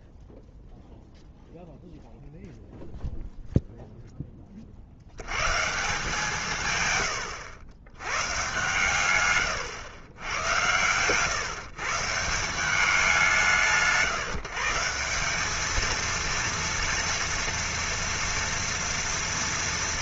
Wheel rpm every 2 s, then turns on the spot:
0, 0, 30, 150, 140, 110, 180, 150, 230, 230.
none